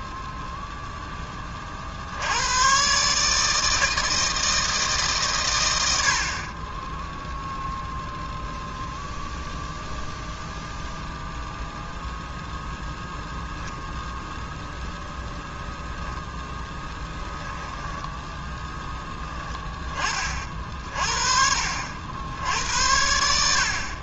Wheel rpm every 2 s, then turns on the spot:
0, 100, 160, 40, 0, 0, 0, 10, 10, 10, 40, 80.
none